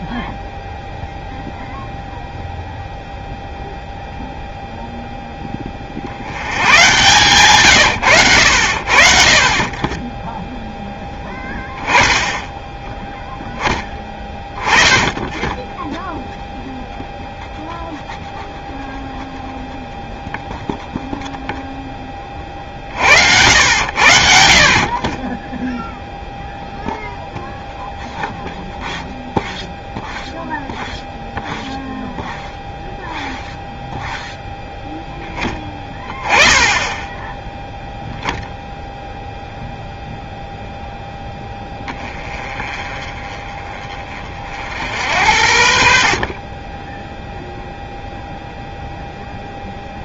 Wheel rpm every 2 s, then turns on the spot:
0, 0, 0, 100, 70, 0, 10, 10, 0, 0, 0, 40, 40, 0, 0, 0, 0, 0, 20, 0, 0, 30, 60, 10, 0.
none